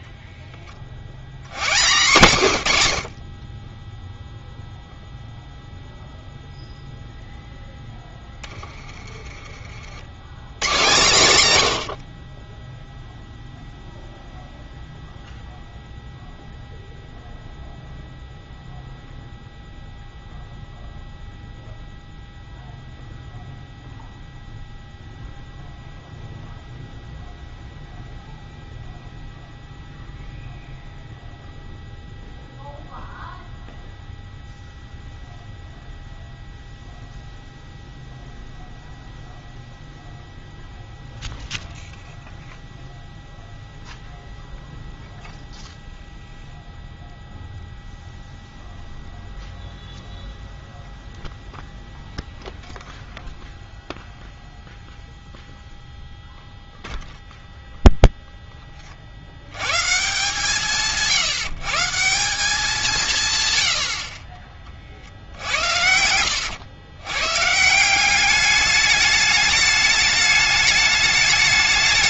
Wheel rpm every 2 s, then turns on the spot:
20, 140, 0, 0, 20, 110, 10, 0, 0, 0, 0, 0, 0, 0, 0, 0, 0, 0, 0, 0, 0, 0, 0, 0, 0, 0, 0, 0, 0, 20, 160, 190, 40, 100, 200, 210.
none